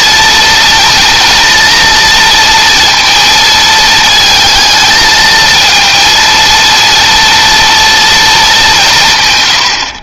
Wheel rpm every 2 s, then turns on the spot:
230, 230, 220, 230, 180.
none